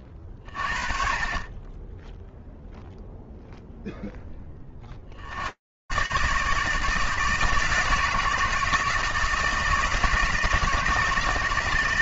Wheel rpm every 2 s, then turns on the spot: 30, 0, 80, 160, 160, 160.
none